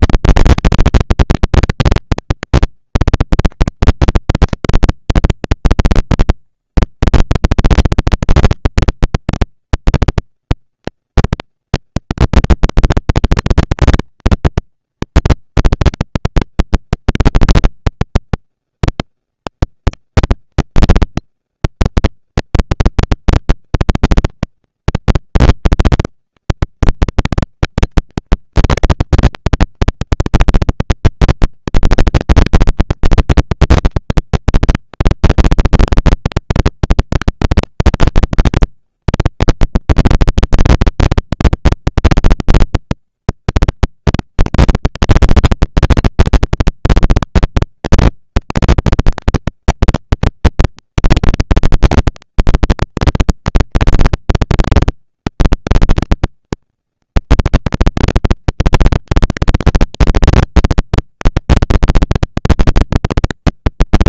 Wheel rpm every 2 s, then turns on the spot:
230, 230, 230, 230, 230, 230, 230, 230, 220, 210, 190, 220, 230, 230, 230, 230, 230, 230, 230, 220, 230, 230, 230, 230, 230, 220, 200, 200, 220, 230, 230, 230.
none